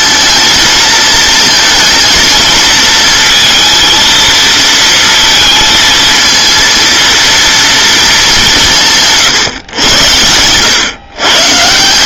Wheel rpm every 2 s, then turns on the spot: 220, 230, 230, 230, 190, 120.
none